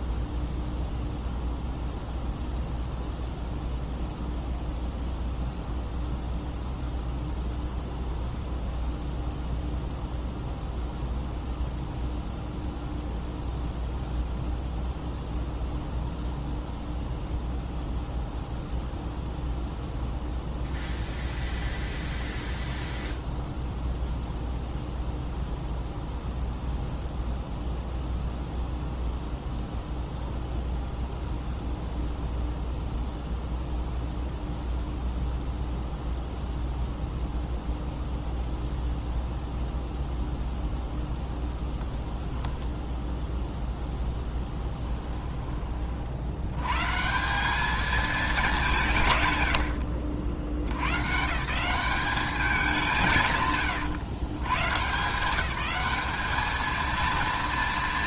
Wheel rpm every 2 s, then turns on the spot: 0, 0, 0, 0, 0, 0, 0, 0, 0, 0, 0, 0, 0, 0, 0, 0, 0, 0, 0, 0, 0, 0, 10, 140, 170, 110, 170, 140, 220.
44-46